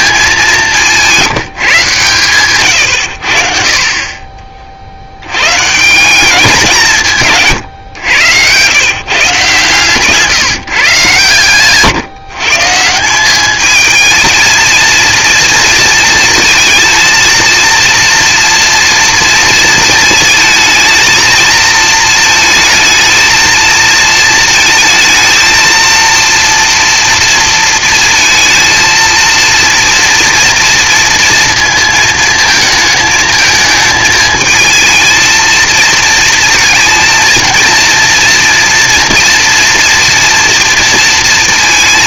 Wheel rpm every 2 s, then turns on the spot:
200, 120, 50, 190, 110, 160, 150, 220, 220, 230, 220, 220, 230, 230, 230, 230, 220, 220, 230, 230, 230.
none